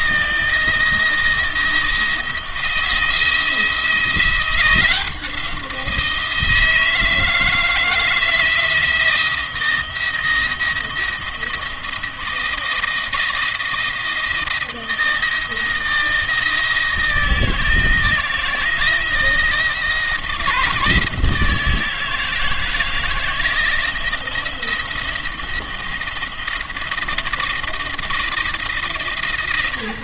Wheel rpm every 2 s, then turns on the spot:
170, 170, 180, 160, 160, 170, 170, 160, 170, 170, 160, 160, 170, 160, 150.
none